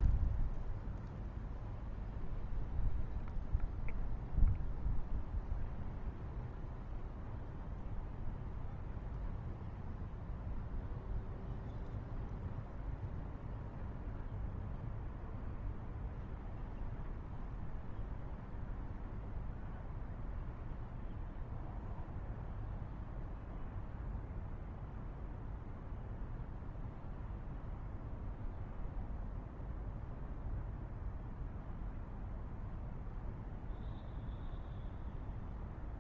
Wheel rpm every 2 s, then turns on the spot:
0, 0, 0, 0, 0, 0, 0, 0, 0, 0, 0, 0, 0, 0, 0, 0, 0, 0.
none